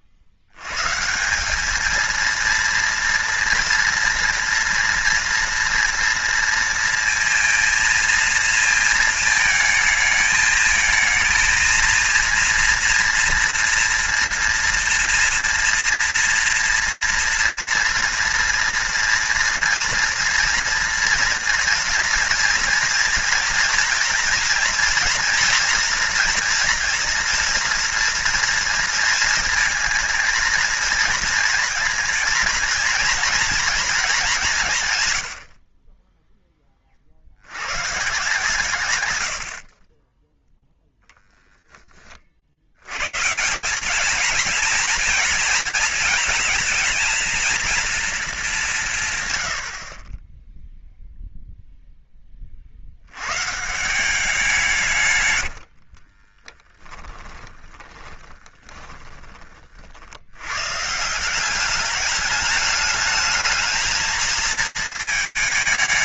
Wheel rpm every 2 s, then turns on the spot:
80, 230, 230, 230, 230, 220, 230, 230, 230, 230, 230, 230, 230, 230, 230, 220, 230, 160, 30, 120, 0, 90, 230, 220, 180, 0, 50, 160, 10, 20, 120, 210, 220.
38-40 56-60